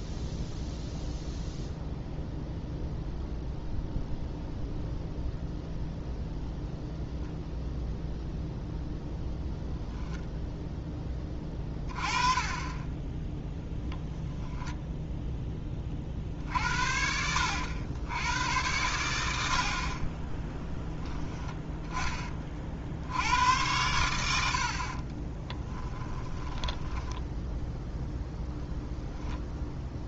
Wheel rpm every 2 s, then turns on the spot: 0, 0, 0, 0, 0, 10, 20, 0, 60, 110, 10, 60, 50, 10, 0.
26-28